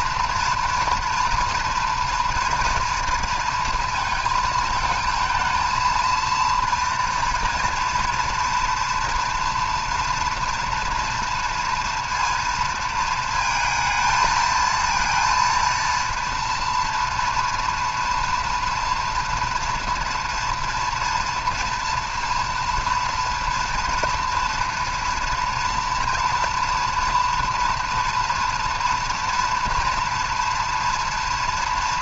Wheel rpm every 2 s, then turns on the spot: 230, 230, 220, 230, 230, 240, 230, 220, 230, 230, 230, 240, 240, 240, 230, 230.
none